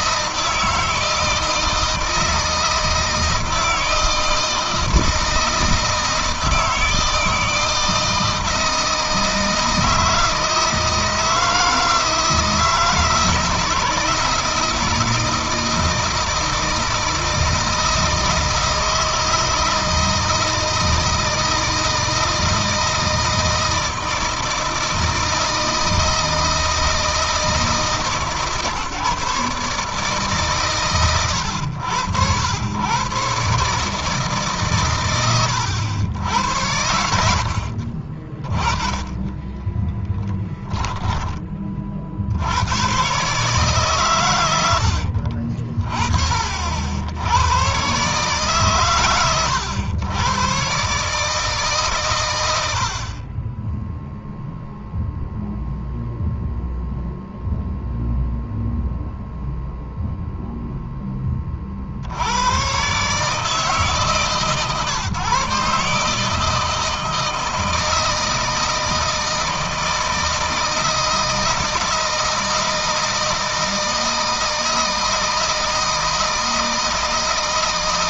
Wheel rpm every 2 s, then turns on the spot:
160, 160, 160, 160, 160, 160, 160, 160, 160, 160, 160, 160, 160, 160, 150, 120, 120, 130, 80, 20, 10, 110, 80, 80, 130, 130, 70, 0, 0, 0, 0, 130, 150, 160, 160, 160, 160, 160, 160.
44-46